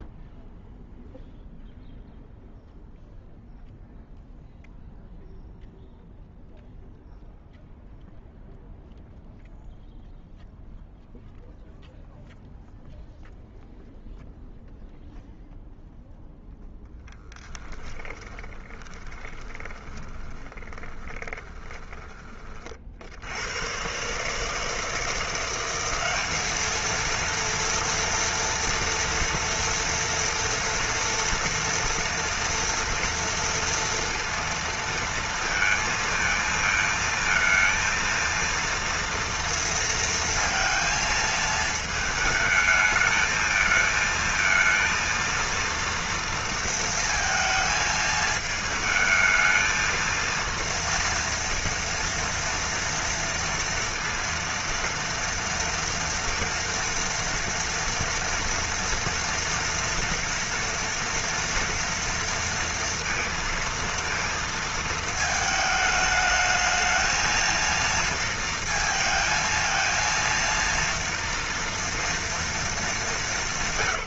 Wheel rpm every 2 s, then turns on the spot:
0, 0, 0, 0, 0, 0, 0, 0, 0, 20, 20, 40, 150, 210, 230, 230, 230, 230, 220, 230, 230, 220, 220, 230, 220, 230, 230, 230, 230, 230, 230, 230, 230, 210, 230, 230, 230.
18-22